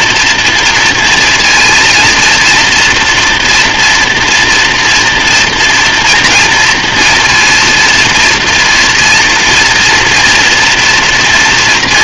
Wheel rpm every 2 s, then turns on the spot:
230, 230, 240, 230, 230, 230.
none